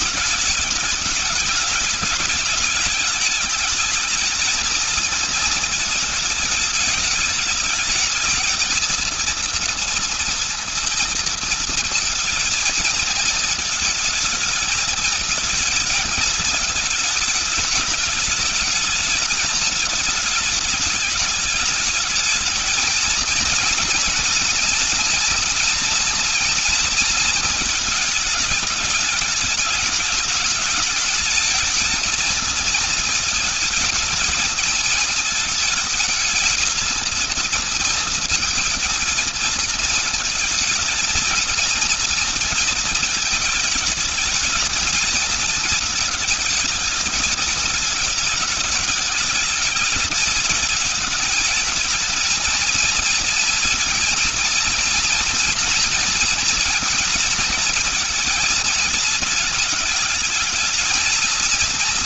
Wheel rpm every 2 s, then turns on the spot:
220, 220, 230, 220, 220, 230, 220, 220, 220, 220, 220, 220, 230, 240, 210, 210, 220, 220, 230, 230, 220, 230, 220, 220, 210, 220, 230, 230, 230, 230, 220.
none